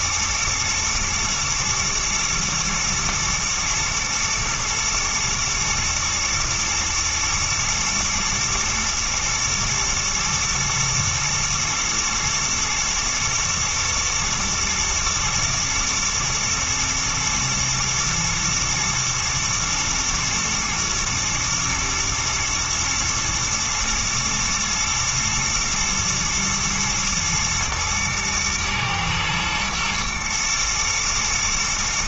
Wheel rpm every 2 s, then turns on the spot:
120, 110, 120, 110, 110, 110, 110, 110, 110, 120, 110, 110, 110, 120, 110, 120.
none